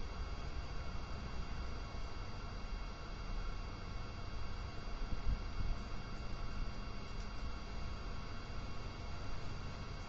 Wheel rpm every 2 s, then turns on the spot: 0, 0, 0, 0, 0.
none